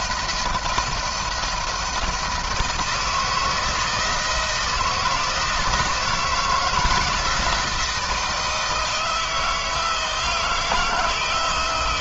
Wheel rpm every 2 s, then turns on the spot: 170, 160, 160, 160, 160, 160.
none